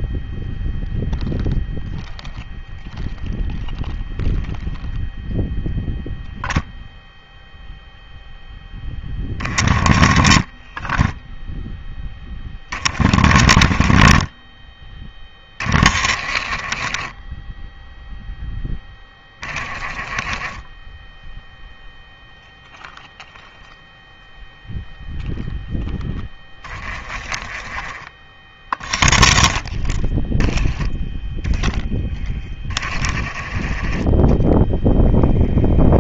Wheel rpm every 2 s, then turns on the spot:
0, 0, 0, 0, 10, 10, 20, 10, 20, 10, 10, 0, 0, 10, 0, 10, 30, 0.
26-28